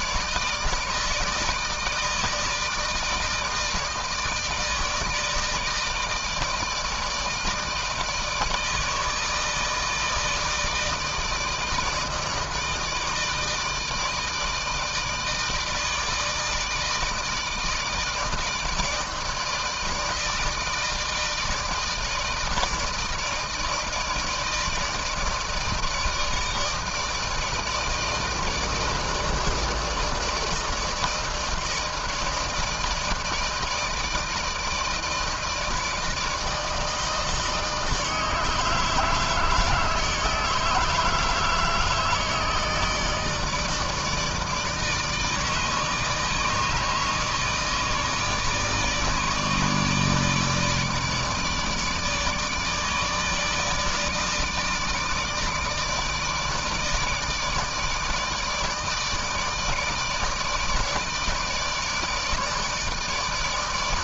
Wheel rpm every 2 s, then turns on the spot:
160, 160, 160, 160, 160, 160, 160, 160, 160, 160, 160, 160, 160, 160, 160, 160, 160, 160, 160, 150, 160, 160, 150, 150, 150, 160, 160, 160, 160, 150, 160, 150.
none